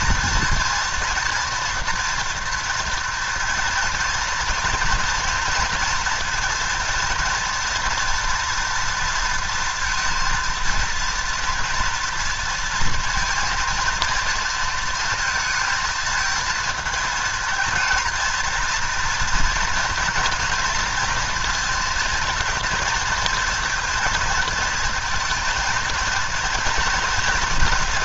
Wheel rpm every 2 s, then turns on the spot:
230, 230, 230, 230, 230, 230, 230, 230, 220, 230, 230, 230, 230, 220.
none